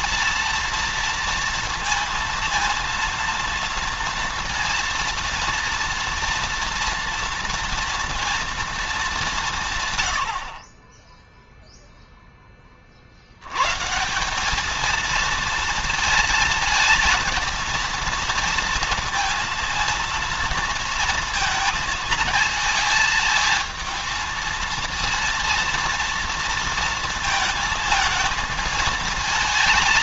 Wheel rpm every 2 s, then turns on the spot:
230, 230, 230, 230, 220, 30, 40, 220, 220, 230, 230, 220, 230, 230, 220.
none